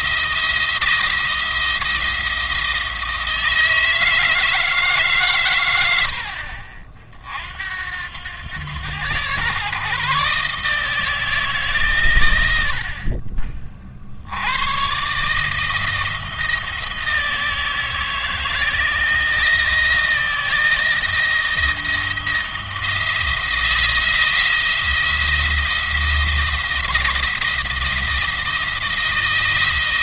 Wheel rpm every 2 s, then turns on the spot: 170, 160, 140, 60, 110, 150, 50, 120, 160, 160, 170, 170, 170, 170, 170.
none